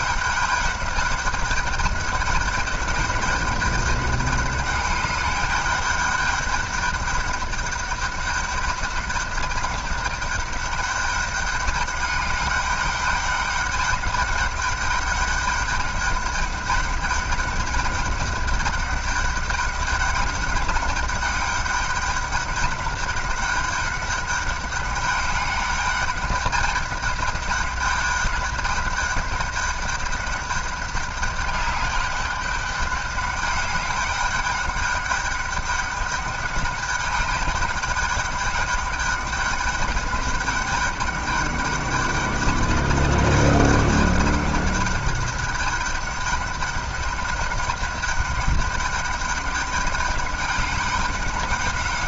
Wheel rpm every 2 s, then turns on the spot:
200, 200, 200, 200, 200, 200, 200, 200, 200, 200, 200, 200, 200, 200, 200, 200, 200, 200, 200, 210, 200, 200, 200, 200, 200, 200.
none